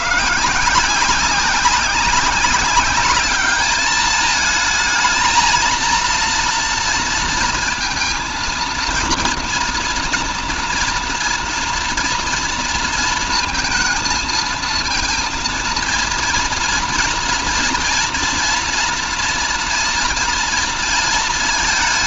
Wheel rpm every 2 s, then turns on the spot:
170, 200, 220, 230, 230, 240, 230, 230, 230, 230, 230.
none